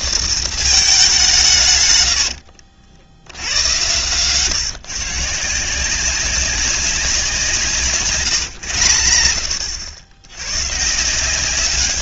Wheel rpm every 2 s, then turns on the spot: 210, 90, 150, 180, 90, 160.
none